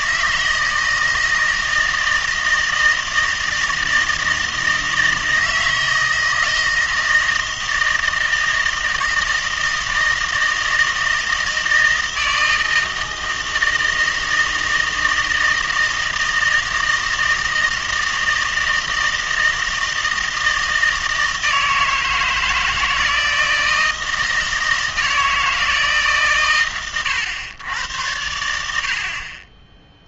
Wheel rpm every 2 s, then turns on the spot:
160, 160, 160, 160, 160, 160, 160, 160, 160, 160, 160, 160, 160, 120, 70.
none